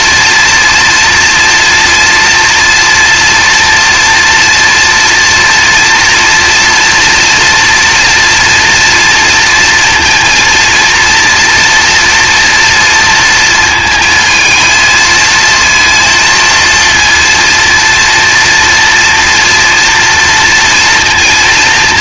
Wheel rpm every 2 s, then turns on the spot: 230, 230, 230, 230, 240, 230, 230, 220, 230, 230, 230.
none